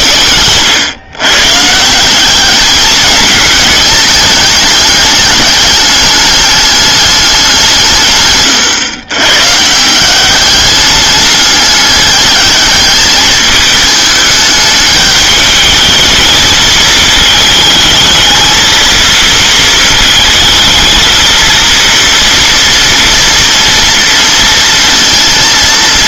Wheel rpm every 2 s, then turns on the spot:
130, 210, 210, 210, 120, 200, 210, 210, 220, 230, 230, 230, 230.
none